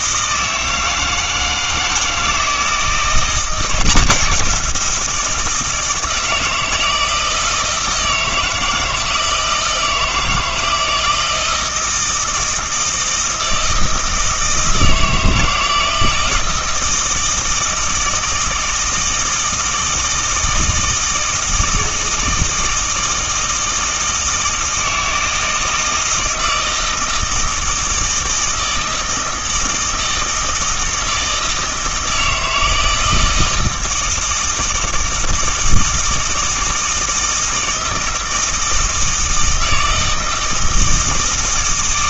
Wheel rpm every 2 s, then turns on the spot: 160, 170, 180, 160, 160, 160, 160, 160, 160, 160, 160, 160, 160, 160, 160, 160, 160, 160, 160, 160, 160.
none